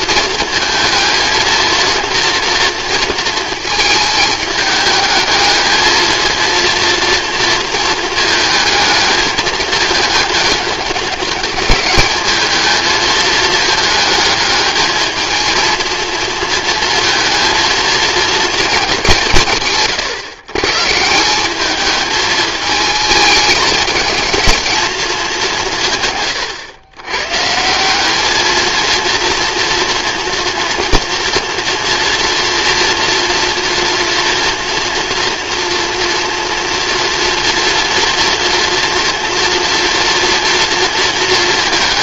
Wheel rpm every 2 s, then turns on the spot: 220, 230, 210, 230, 220, 210, 220, 220, 230, 220, 140, 220, 220, 110, 220, 230, 230, 230, 230, 230, 230.
none